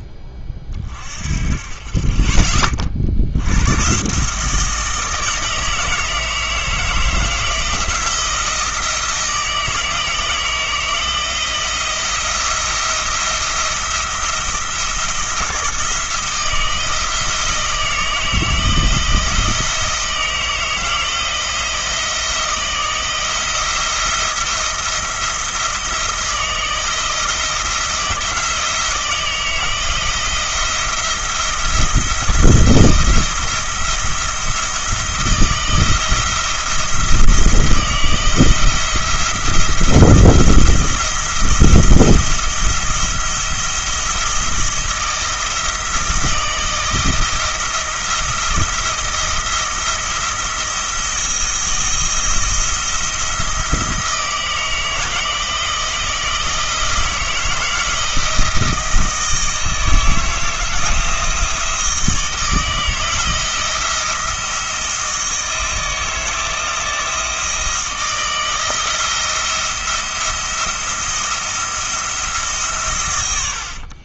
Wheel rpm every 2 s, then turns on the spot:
30, 40, 160, 160, 170, 160, 170, 160, 170, 160, 160, 170, 170, 160, 170, 170, 170, 170, 170, 170, 170, 170, 160, 170, 170, 160, 170, 160, 160, 160, 160, 160, 160, 160, 170, 170, 140.
none